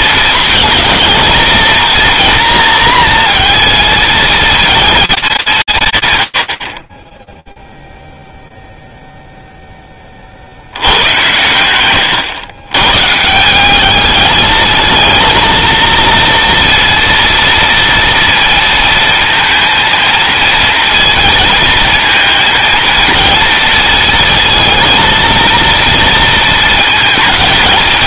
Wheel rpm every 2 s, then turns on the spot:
220, 230, 230, 40, 0, 100, 140, 220, 230, 230, 230, 230, 230, 220.
none